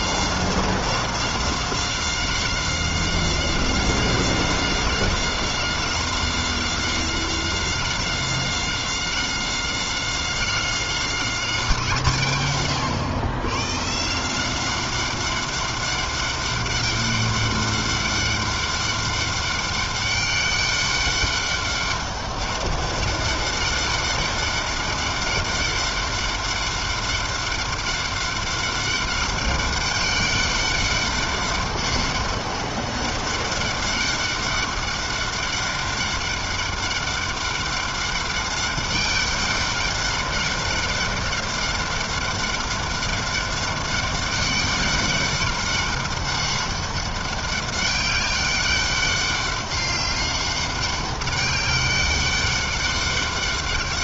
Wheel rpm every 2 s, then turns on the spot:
190, 190, 190, 190, 190, 190, 110, 200, 200, 200, 200, 200, 200, 200, 200, 200, 200, 200, 200, 200, 200, 200, 200, 200, 200, 200, 200.
none